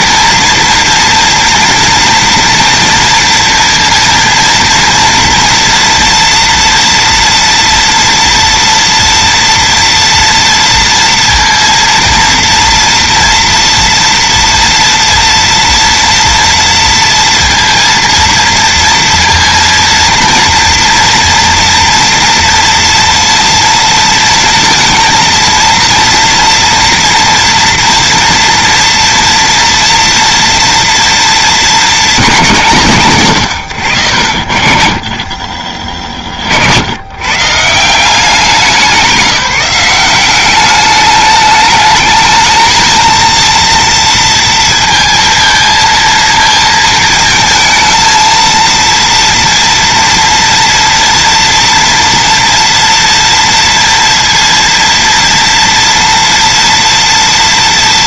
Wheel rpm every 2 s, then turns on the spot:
230, 230, 230, 230, 230, 230, 230, 230, 230, 230, 230, 230, 230, 240, 230, 230, 150, 30, 100, 190, 210, 230, 230, 220, 230, 230, 230, 230, 230.
none